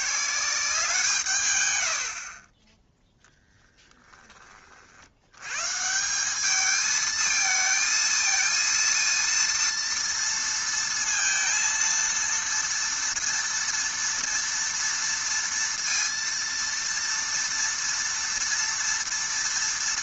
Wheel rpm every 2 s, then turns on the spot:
190, 20, 40, 210, 230, 230, 230, 230, 230, 230.
none